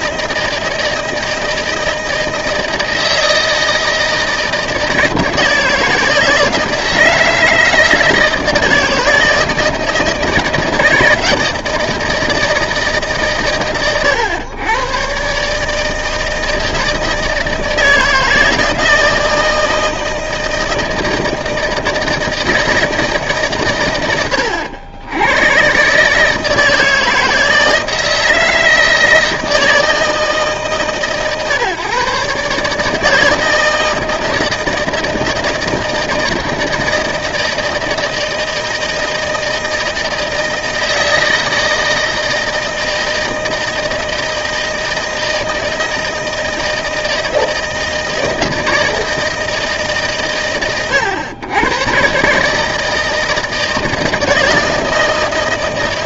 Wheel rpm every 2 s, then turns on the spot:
160, 160, 160, 160, 160, 160, 160, 110, 160, 160, 160, 160, 90, 160, 160, 150, 140, 160, 160, 160, 160, 160, 160, 160, 160, 110, 150, 160.
none